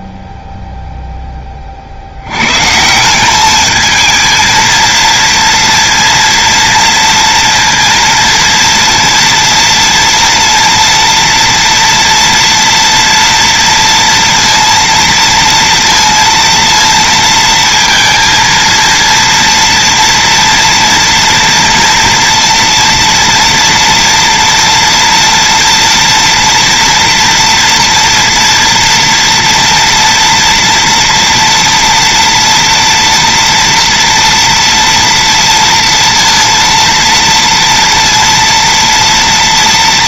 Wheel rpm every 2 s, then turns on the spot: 0, 140, 230, 230, 230, 230, 230, 230, 230, 230, 230, 230, 230, 230, 230, 230, 230, 240, 230, 230.
none